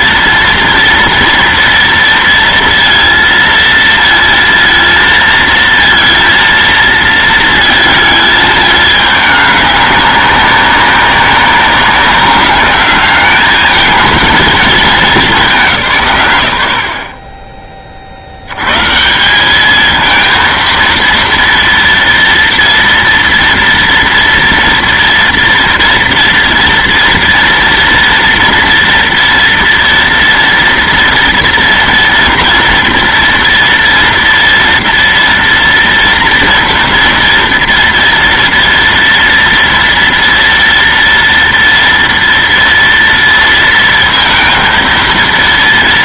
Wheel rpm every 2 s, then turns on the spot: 230, 230, 230, 230, 210, 200, 200, 210, 60, 150, 230, 230, 230, 230, 230, 240, 240, 230, 230, 230, 230, 230, 230.
none